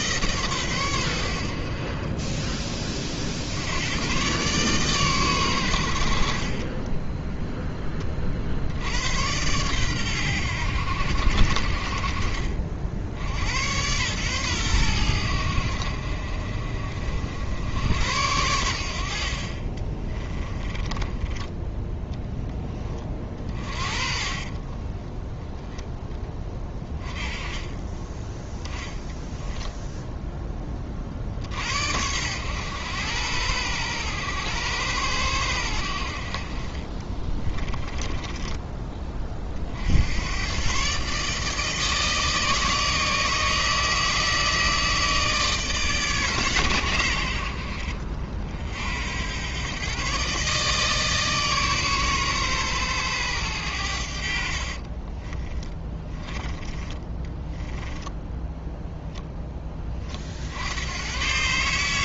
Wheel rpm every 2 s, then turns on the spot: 110, 30, 130, 20, 80, 90, 60, 100, 50, 70, 20, 20, 20, 20, 10, 40, 100, 110, 40, 20, 140, 160, 160, 110, 70, 150, 120, 40, 20, 0, 90.
6-8 24-28 36-38 54-58